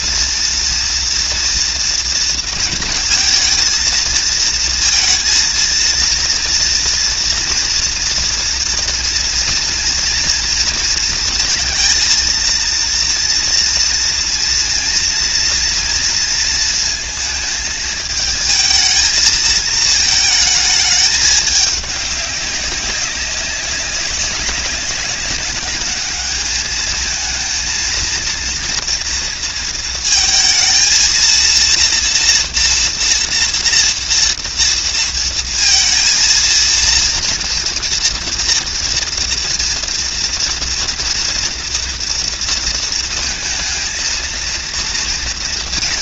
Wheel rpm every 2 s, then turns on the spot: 230, 220, 230, 240, 230, 230, 230, 230, 230, 220, 210, 190, 200, 220, 230, 230, 240, 230, 230, 230, 240, 230, 230.
none